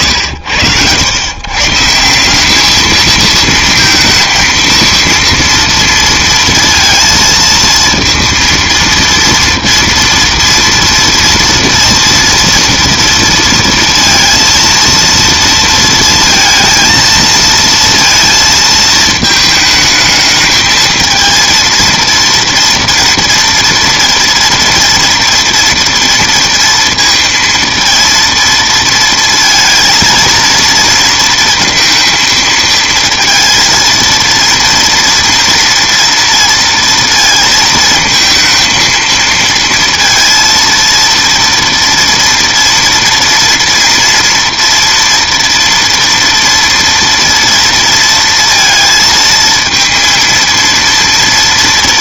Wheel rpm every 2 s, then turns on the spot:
90, 210, 230, 230, 230, 230, 230, 230, 230, 220, 220, 230, 230, 230, 230, 230, 220, 230, 230, 220, 230, 240, 240, 230, 230, 230.
none